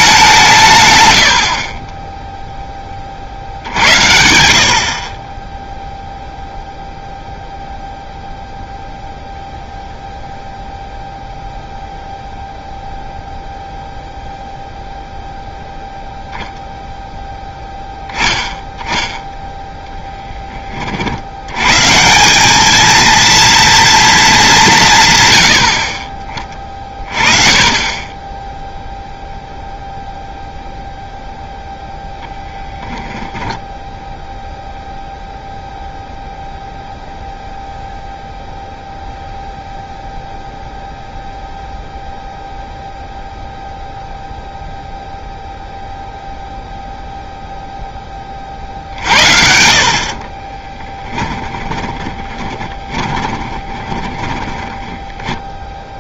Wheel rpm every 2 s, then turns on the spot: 150, 10, 70, 0, 0, 0, 0, 0, 0, 10, 20, 210, 180, 30, 0, 0, 10, 0, 0, 0, 0, 0, 0, 0, 40, 20, 30, 10.
32-34 50-56